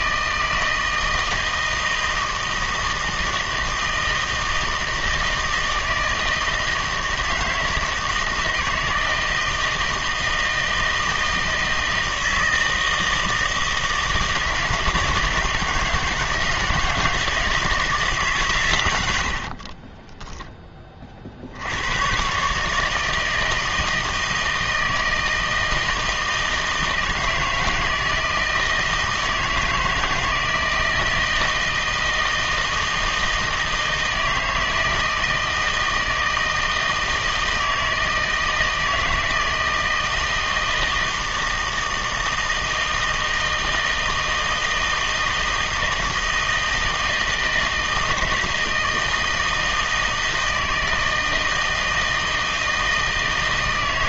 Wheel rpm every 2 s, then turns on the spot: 160, 160, 160, 160, 160, 160, 160, 160, 160, 110, 20, 150, 160, 160, 160, 160, 160, 160, 160, 160, 160, 160, 160, 160, 160, 160, 160.
none